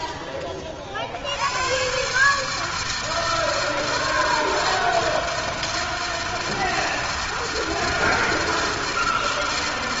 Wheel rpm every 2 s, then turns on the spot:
90, 160, 160, 160, 160.
none